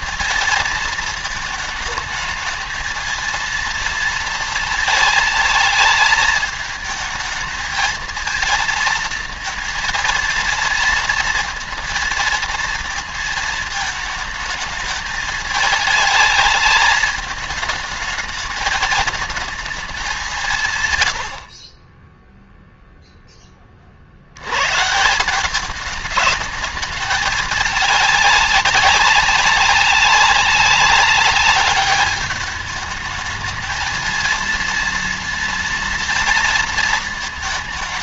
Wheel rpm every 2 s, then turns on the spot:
230, 220, 230, 220, 230, 230, 230, 220, 210, 220, 160, 0, 120, 210, 200, 190, 210, 230, 230.
none